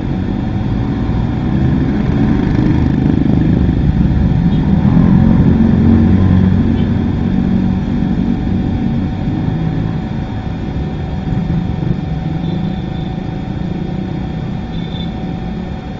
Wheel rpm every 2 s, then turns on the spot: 0, 0, 0, 0, 0, 0, 0, 0.
none